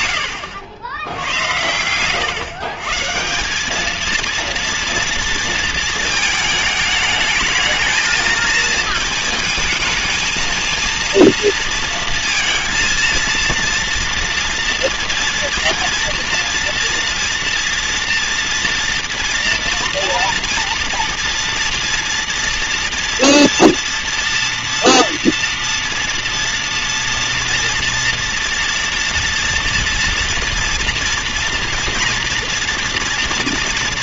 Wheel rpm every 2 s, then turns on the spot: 70, 180, 230, 220, 220, 230, 230, 240, 230, 230, 230, 230, 230, 230, 230, 230, 240.
none